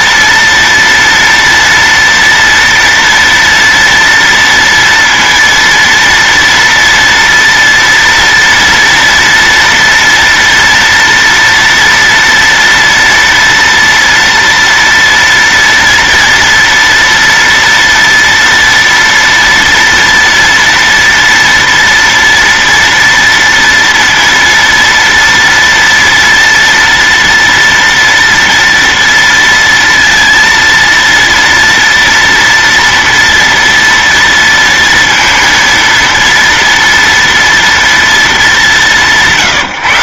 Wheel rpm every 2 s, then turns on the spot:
230, 230, 230, 230, 230, 230, 230, 230, 230, 240, 230, 230, 230, 240, 230, 230, 230, 230, 230, 180.
none